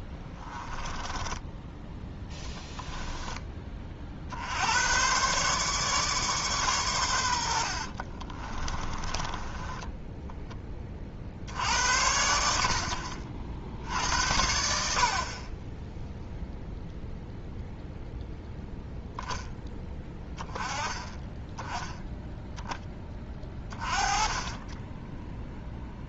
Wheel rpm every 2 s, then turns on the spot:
10, 10, 90, 120, 20, 30, 70, 60, 0, 0, 10, 10, 20.
0-4 8-10